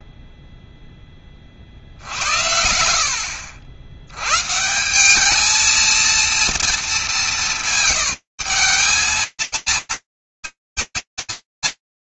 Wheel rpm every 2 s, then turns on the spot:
30, 60, 210, 200, 190, 230.
none